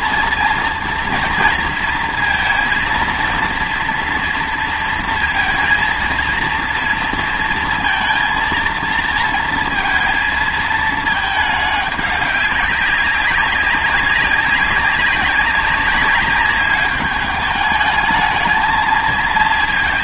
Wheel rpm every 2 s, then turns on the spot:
230, 230, 230, 230, 230, 220, 200, 190, 200, 220.
none